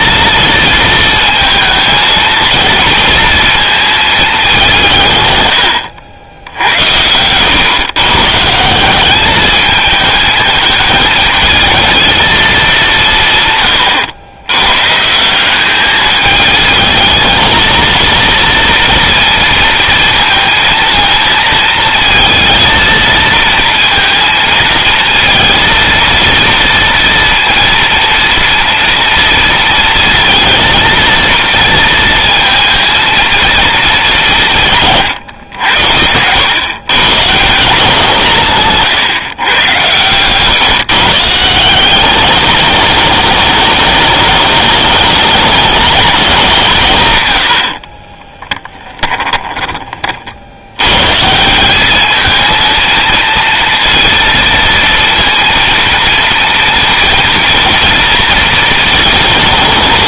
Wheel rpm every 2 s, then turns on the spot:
230, 220, 180, 90, 170, 220, 190, 130, 220, 230, 230, 220, 230, 230, 230, 230, 230, 150, 120, 140, 140, 210, 210, 160, 10, 90, 220, 230, 230, 230.
6-8 34-36 38-40 48-50